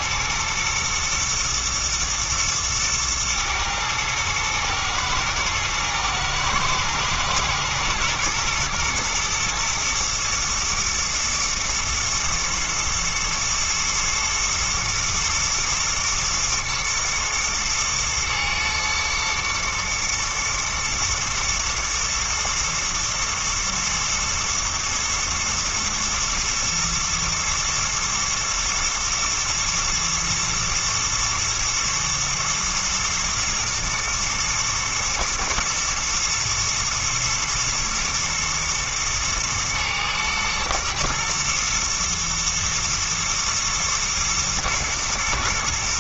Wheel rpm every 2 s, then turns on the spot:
110, 110, 110, 120, 110, 110, 110, 120, 110, 110, 110, 110, 120, 120, 120, 120, 110, 120, 120, 110, 110, 120, 120.
none